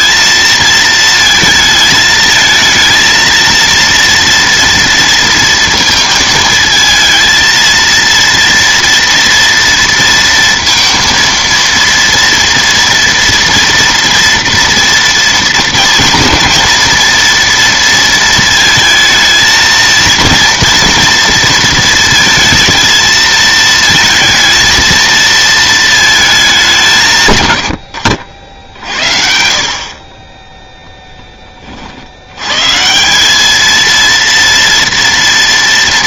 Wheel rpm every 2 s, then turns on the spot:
220, 220, 230, 220, 230, 230, 230, 240, 220, 220, 230, 220, 230, 200, 70, 10, 130, 230.
none